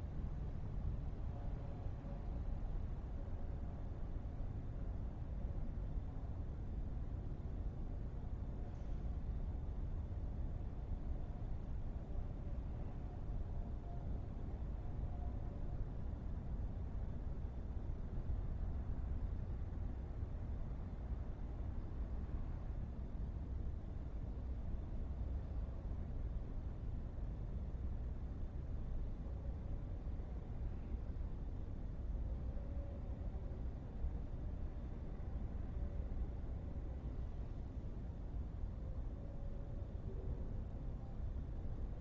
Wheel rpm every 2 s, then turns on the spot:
0, 0, 0, 0, 0, 0, 0, 0, 0, 0, 0, 0, 0, 0, 0, 0, 0, 0, 0, 0, 0.
none